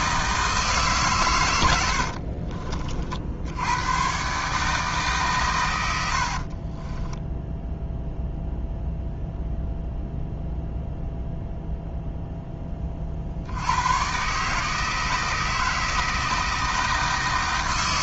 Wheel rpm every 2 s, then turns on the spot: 150, 40, 150, 30, 0, 0, 30, 160, 160.
6-8